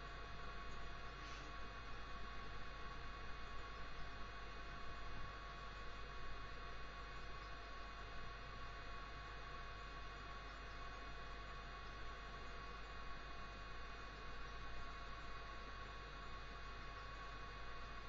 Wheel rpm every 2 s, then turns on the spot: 0, 0, 0, 0, 0, 0, 0, 0, 0.
none